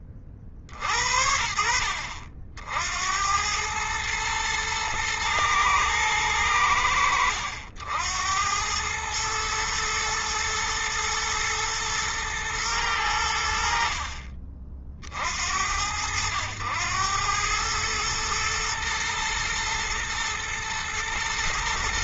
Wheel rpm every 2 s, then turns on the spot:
40, 70, 120, 90, 90, 110, 110, 50, 100, 110, 120.
none